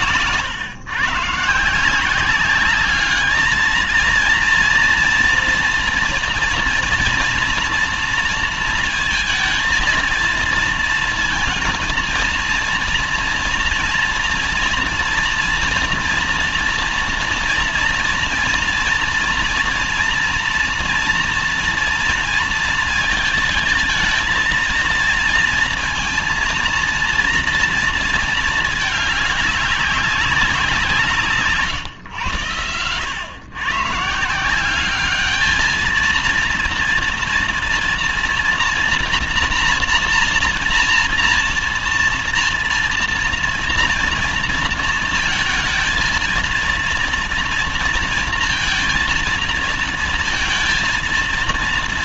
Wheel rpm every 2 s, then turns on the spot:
140, 200, 230, 230, 230, 230, 230, 230, 240, 230, 230, 230, 230, 230, 220, 180, 90, 180, 230, 240, 230, 230, 230, 230, 230, 230.
none